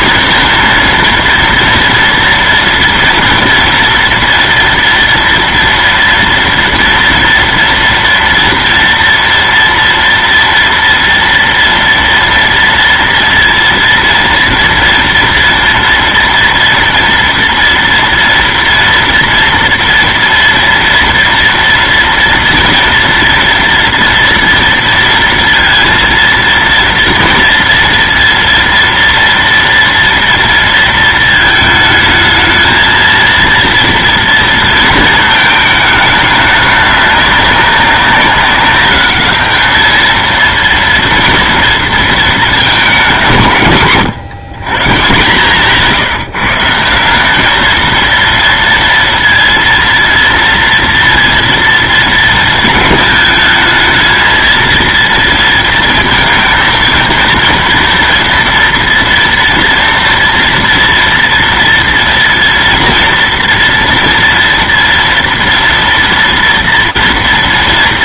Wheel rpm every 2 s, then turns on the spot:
230, 230, 230, 230, 230, 230, 230, 230, 230, 230, 230, 240, 230, 230, 230, 230, 220, 230, 200, 200, 230, 230, 130, 160, 230, 230, 220, 230, 230, 230, 240, 230, 230, 230.
none